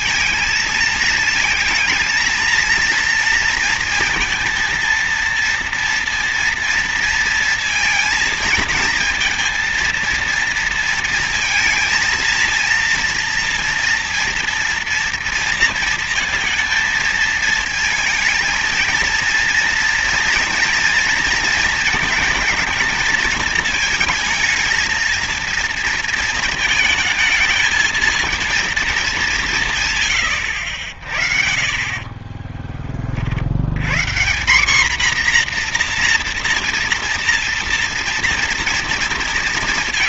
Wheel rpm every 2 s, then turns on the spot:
220, 230, 230, 230, 220, 230, 230, 230, 230, 220, 240, 220, 220, 220, 220, 60, 20, 220, 230, 230.
none